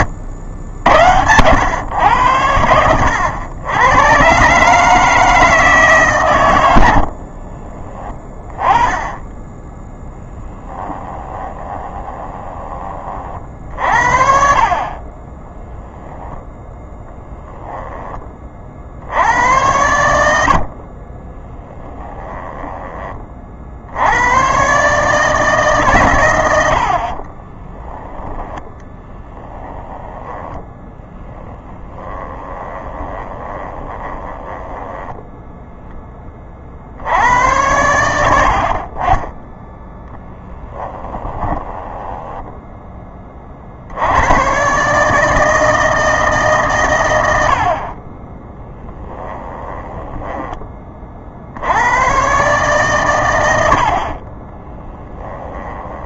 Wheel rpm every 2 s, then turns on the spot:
70, 90, 150, 70, 10, 10, 30, 30, 0, 50, 40, 20, 140, 60, 10, 10, 20, 10, 60, 40, 10, 10, 140, 120, 10, 30, 130, 20.
10-12 20-22 28-30 32-36 40-42 48-50 54-56